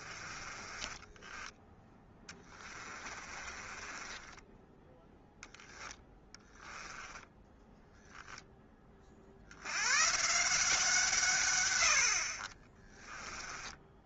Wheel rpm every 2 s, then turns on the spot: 20, 20, 20, 10, 0, 170, 30.
0-8 12-14